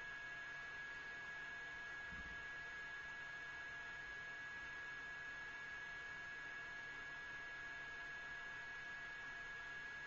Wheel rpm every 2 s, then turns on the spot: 0, 0, 0, 0, 0.
none